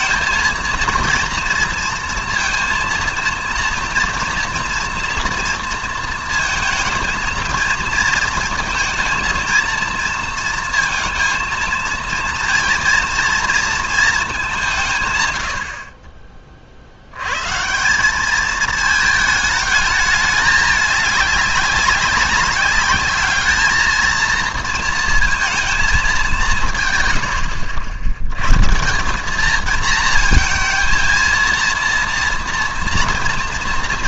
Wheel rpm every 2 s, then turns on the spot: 230, 230, 230, 230, 230, 230, 230, 180, 40, 220, 210, 200, 230, 170, 140, 230, 230.
none